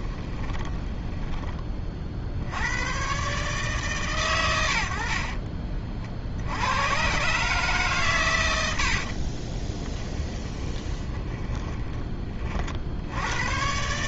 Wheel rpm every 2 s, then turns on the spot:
20, 110, 70, 110, 70, 20, 60.
0-2 8-12